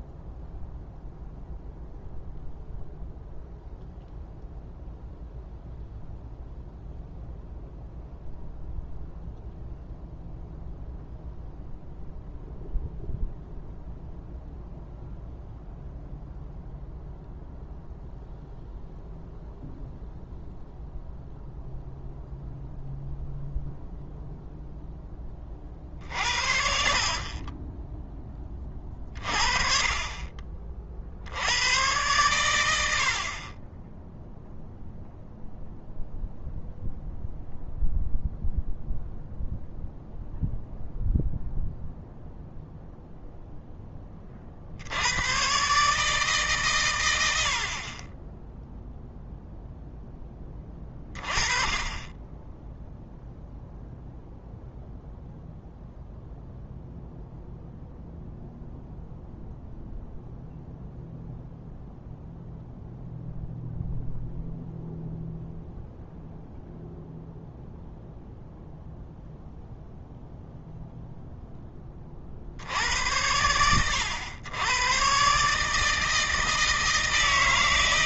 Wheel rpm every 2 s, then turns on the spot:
0, 0, 0, 0, 0, 0, 0, 0, 0, 0, 0, 0, 10, 50, 30, 40, 100, 0, 0, 0, 0, 0, 50, 130, 0, 20, 10, 0, 0, 0, 0, 0, 0, 0, 0, 0, 70, 110, 160.
none